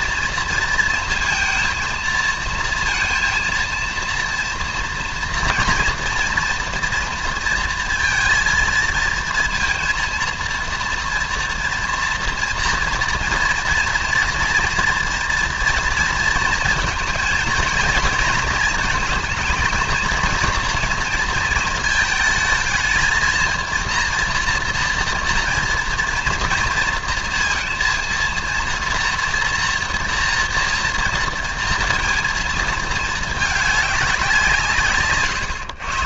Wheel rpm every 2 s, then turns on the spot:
230, 230, 230, 230, 230, 230, 230, 240, 230, 220, 230, 220, 230, 230, 230, 230, 230, 160.
none